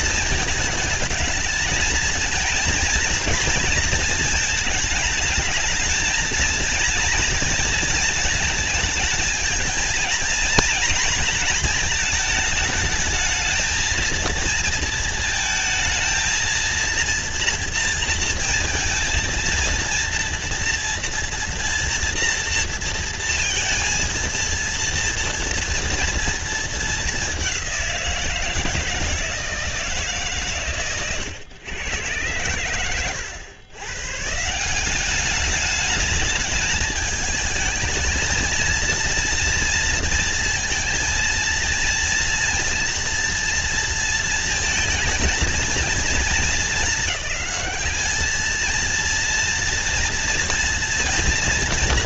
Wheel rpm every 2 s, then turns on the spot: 220, 230, 230, 230, 220, 230, 220, 230, 230, 230, 230, 230, 230, 220, 170, 130, 110, 160, 210, 220, 230, 230, 230, 210, 220, 240.
none